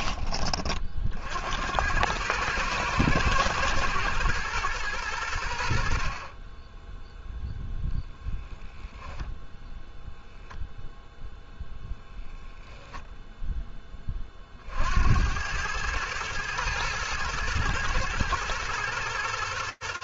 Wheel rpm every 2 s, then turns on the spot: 40, 110, 110, 20, 10, 0, 10, 70, 110, 110.
none